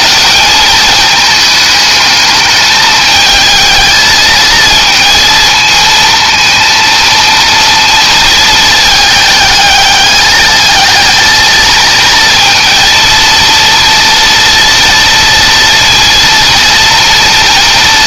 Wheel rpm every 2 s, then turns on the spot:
210, 220, 230, 230, 220, 220, 230, 230, 230.
none